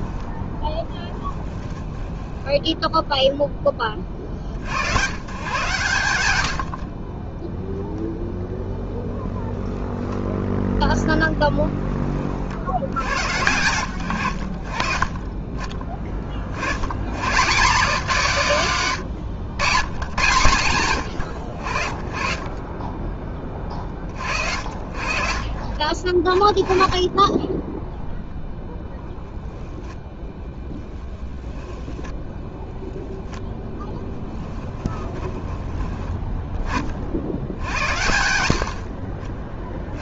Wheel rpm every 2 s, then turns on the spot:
10, 0, 100, 30, 0, 10, 100, 30, 100, 140, 120, 20, 60, 20, 0, 10, 10, 10, 40, 60.
0-2 30-32 34-36